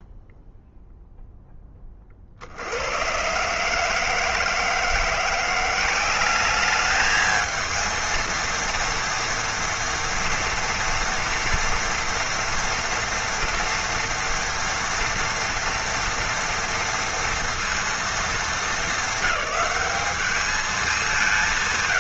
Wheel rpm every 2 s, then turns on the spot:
0, 70, 160, 200, 230, 230, 230, 230, 240, 220, 210.
none